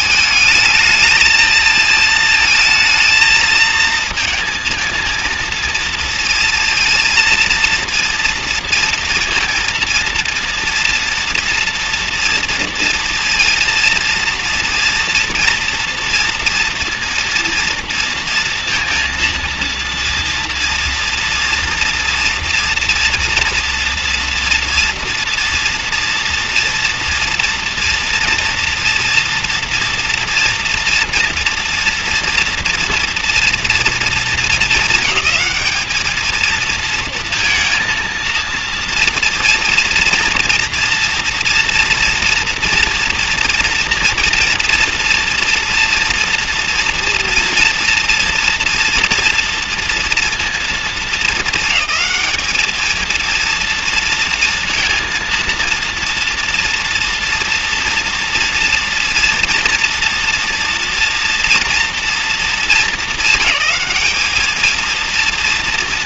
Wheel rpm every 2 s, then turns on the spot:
210, 220, 220, 230, 230, 230, 230, 230, 230, 230, 230, 230, 240, 230, 230, 230, 230, 220, 220, 230, 240, 230, 230, 230, 230, 220, 210, 230, 230, 240, 230, 210, 220.
none